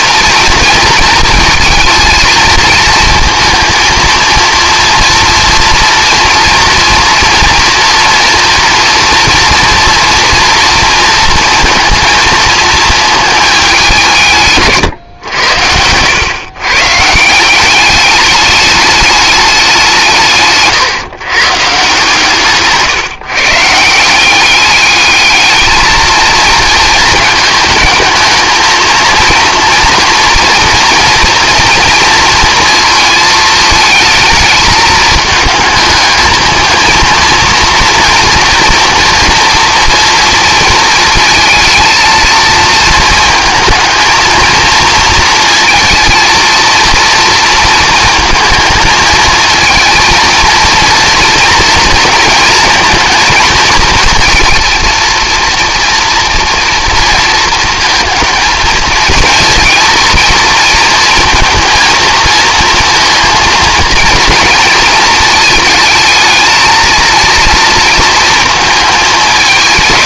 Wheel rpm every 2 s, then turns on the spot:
230, 230, 230, 230, 230, 230, 230, 140, 130, 210, 150, 140, 200, 220, 220, 230, 220, 220, 220, 240, 230, 230, 230, 230, 220, 230, 230, 230, 230, 230, 220, 230, 230, 220, 220.
none